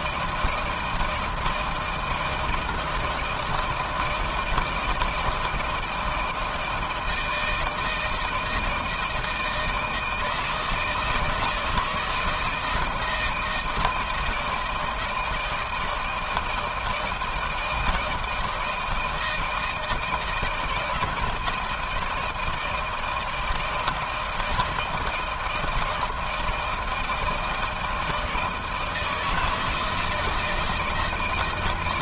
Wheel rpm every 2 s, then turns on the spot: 170, 160, 160, 160, 160, 160, 160, 160, 160, 160, 160, 160, 160, 160, 160, 160.
none